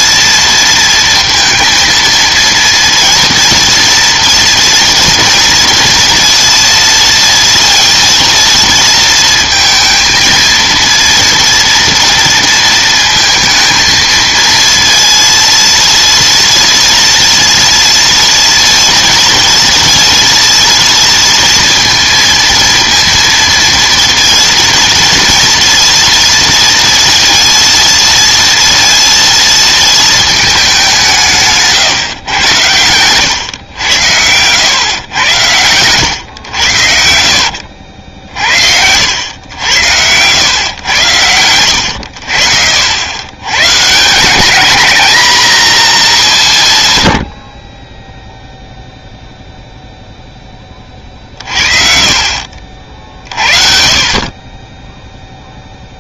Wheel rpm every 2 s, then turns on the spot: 230, 230, 230, 230, 230, 230, 230, 230, 230, 230, 230, 230, 230, 230, 230, 200, 110, 120, 90, 70, 110, 70, 210, 150, 0, 20, 50, 20.
none